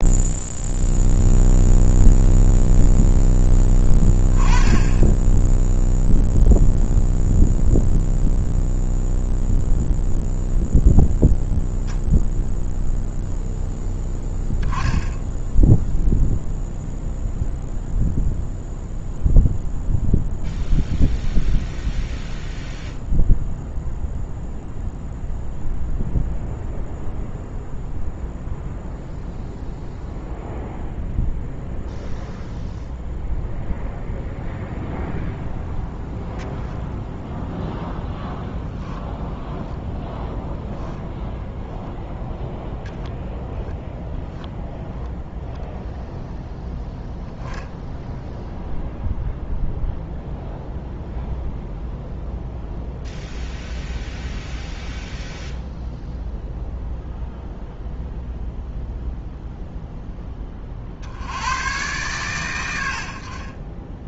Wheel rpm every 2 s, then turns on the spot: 0, 0, 10, 0, 0, 0, 0, 10, 0, 0, 0, 0, 0, 0, 0, 0, 0, 0, 0, 0, 10, 0, 0, 0, 0, 0, 0, 0, 0, 0, 50, 70.
40-42